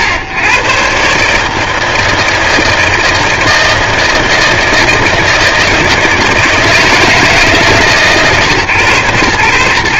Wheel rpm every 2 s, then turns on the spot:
110, 160, 160, 160, 140.
none